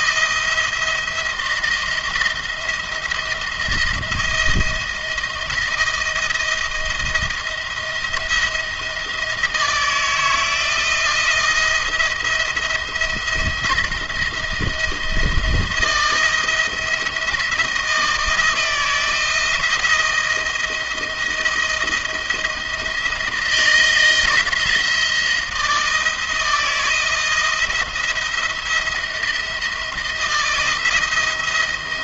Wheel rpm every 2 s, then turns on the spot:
170, 170, 170, 170, 160, 160, 170, 170, 170, 160, 170, 170, 170, 160, 170, 160.
none